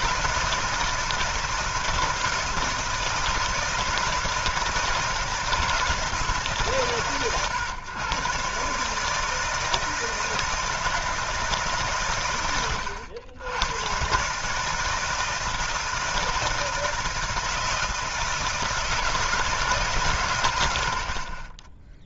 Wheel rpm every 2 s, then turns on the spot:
160, 160, 160, 150, 140, 160, 100, 160, 160, 160, 90.
none